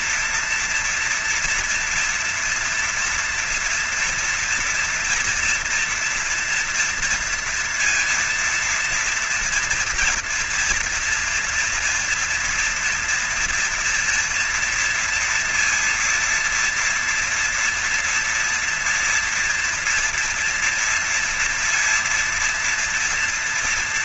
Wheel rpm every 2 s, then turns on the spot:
230, 230, 230, 230, 230, 230, 240, 230, 230, 230, 230, 230.
none